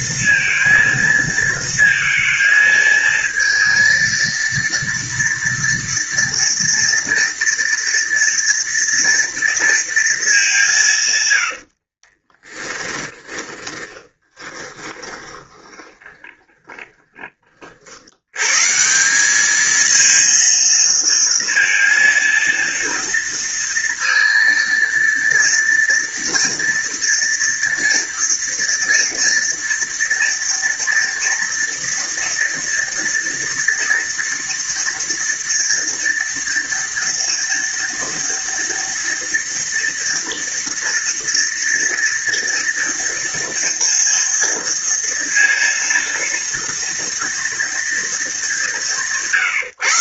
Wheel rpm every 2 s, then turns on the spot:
230, 230, 230, 230, 240, 210, 30, 20, 10, 90, 230, 230, 230, 230, 230, 230, 230, 230, 230, 230, 230, 230, 230, 230, 200.
12-16